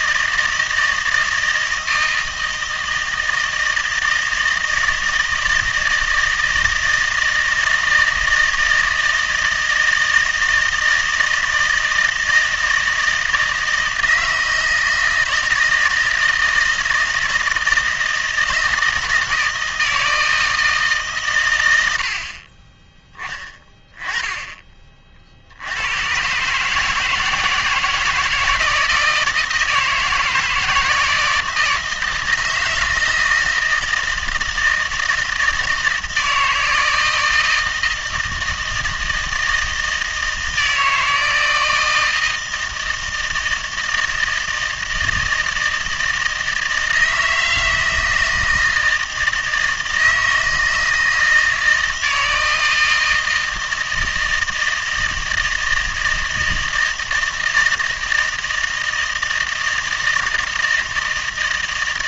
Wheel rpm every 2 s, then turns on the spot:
160, 160, 160, 160, 160, 160, 160, 160, 160, 160, 160, 30, 20, 150, 160, 160, 160, 160, 160, 160, 160, 160, 160, 160, 160, 160, 160, 160, 160, 160, 160.
none